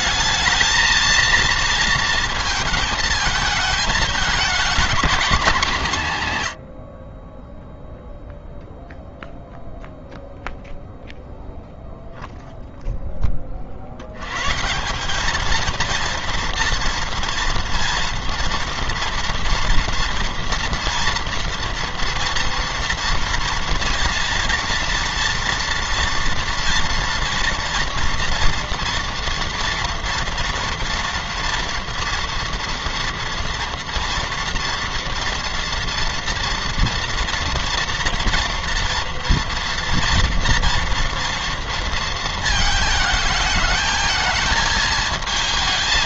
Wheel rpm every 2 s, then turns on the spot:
230, 220, 230, 60, 0, 0, 0, 180, 230, 230, 230, 230, 230, 230, 240, 230, 230, 230, 230, 230, 230, 220, 220.
none